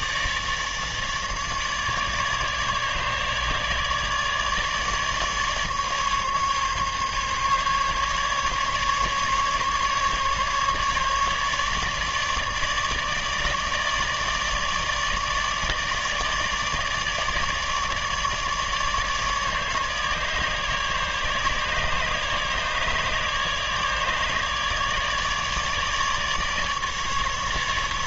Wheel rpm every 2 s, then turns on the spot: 150, 150, 150, 140, 140, 150, 150, 150, 150, 150, 150, 150, 150, 150.
none